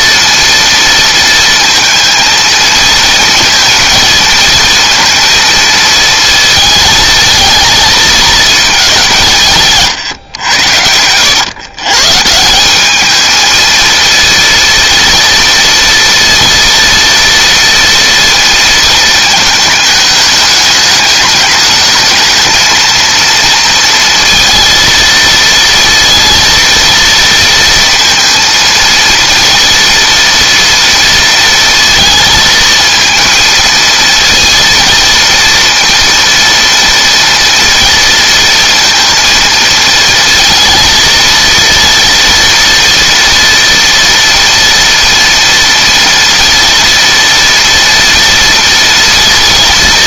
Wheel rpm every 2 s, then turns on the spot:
230, 220, 230, 220, 200, 100, 190, 230, 230, 230, 210, 230, 230, 230, 230, 230, 230, 230, 230, 230, 230, 230, 230, 230, 230.
10-12